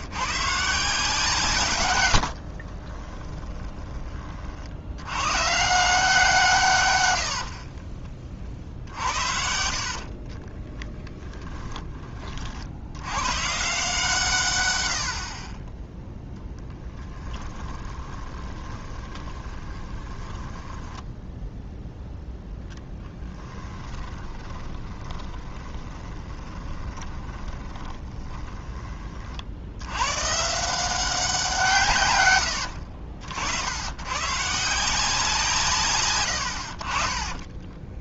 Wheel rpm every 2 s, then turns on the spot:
160, 40, 70, 130, 50, 10, 80, 90, 10, 20, 10, 10, 20, 20, 20, 170, 60, 160, 50.
2-4 10-12 16-28